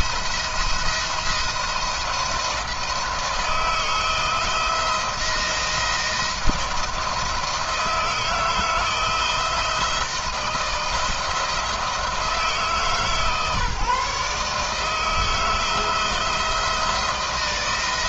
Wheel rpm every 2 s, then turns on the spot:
170, 160, 160, 160, 160, 170, 160, 160, 160.
none